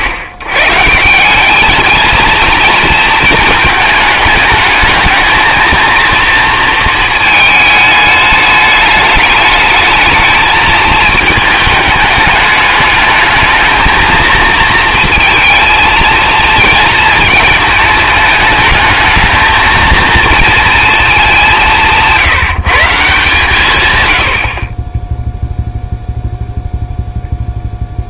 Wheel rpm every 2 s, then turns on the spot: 120, 220, 220, 230, 210, 220, 210, 220, 230, 220, 230, 160, 10, 0.
none